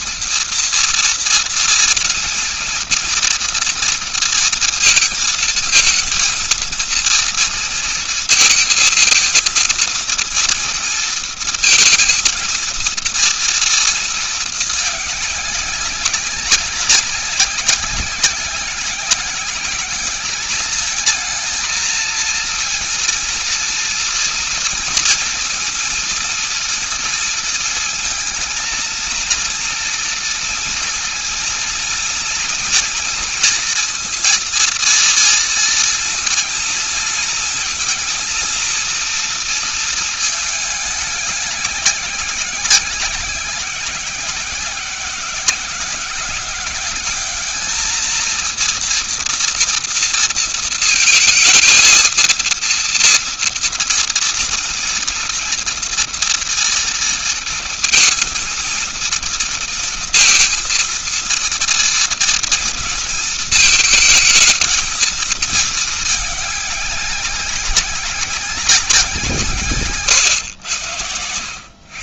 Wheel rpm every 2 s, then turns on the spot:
230, 230, 230, 230, 230, 230, 230, 220, 200, 190, 210, 230, 230, 230, 230, 230, 230, 230, 230, 230, 210, 190, 190, 190, 230, 230, 230, 230, 230, 220, 230, 230, 230, 210, 200, 120.
none